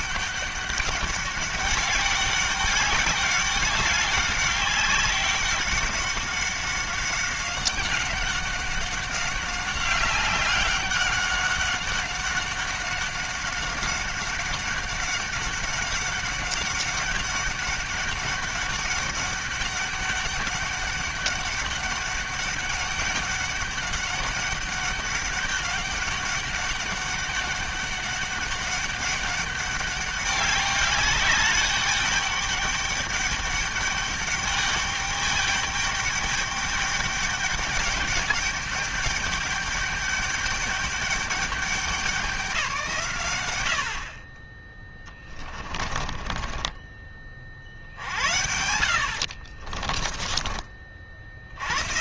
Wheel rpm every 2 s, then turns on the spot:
200, 200, 190, 190, 190, 190, 190, 190, 200, 200, 200, 200, 200, 200, 200, 200, 200, 210, 200, 210, 210, 180, 30, 20, 70, 30.
46-50